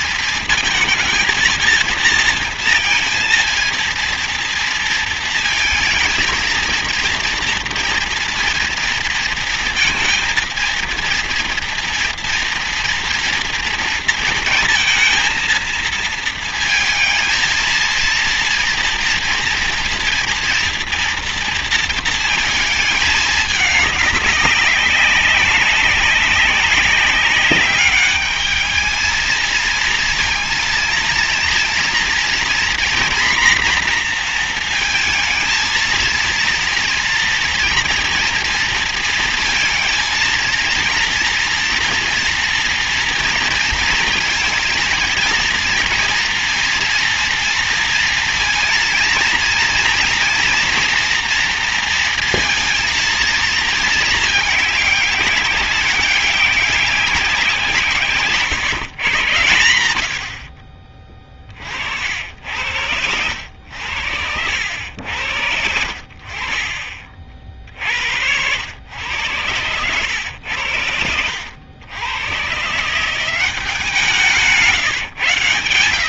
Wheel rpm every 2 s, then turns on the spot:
220, 230, 230, 230, 230, 230, 230, 230, 220, 230, 230, 220, 200, 190, 220, 230, 240, 230, 230, 230, 230, 230, 230, 230, 230, 230, 230, 210, 200, 130, 30, 80, 80, 50, 90, 90, 150, 140.
60-62